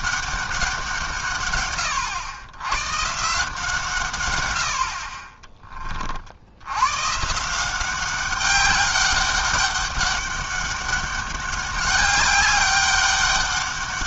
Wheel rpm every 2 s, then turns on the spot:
180, 110, 80, 90, 200, 200, 200.
none